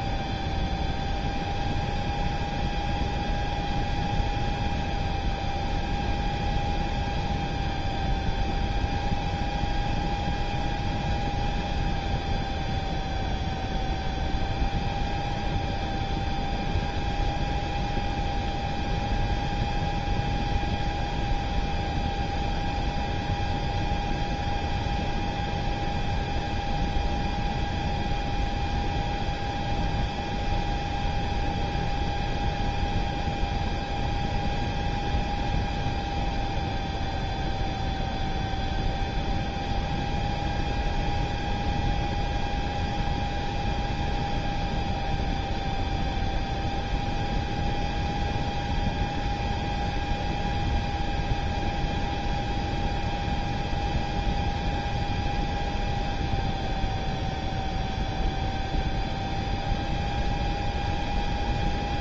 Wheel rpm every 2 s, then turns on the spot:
0, 0, 0, 0, 0, 0, 0, 0, 0, 0, 0, 0, 0, 0, 0, 0, 0, 0, 0, 0, 0, 0, 0, 0, 0, 0, 0, 0, 0, 0, 0.
none